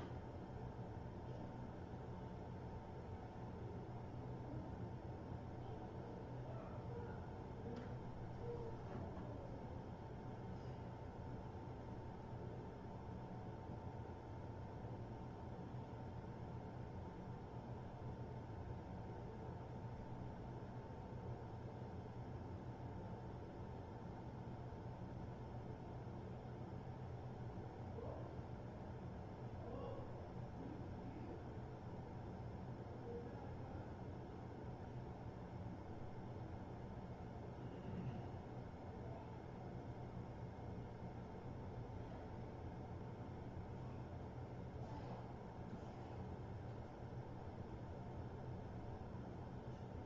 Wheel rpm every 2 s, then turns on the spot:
0, 0, 0, 0, 0, 0, 0, 0, 0, 0, 0, 0, 0, 0, 0, 0, 0, 0, 0, 0, 0, 0, 0, 0, 0.
none